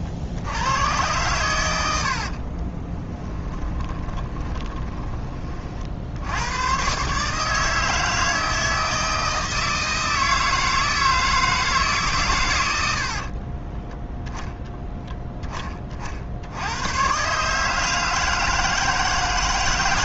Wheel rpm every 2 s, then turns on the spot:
100, 20, 20, 120, 160, 160, 80, 10, 110, 150.
2-6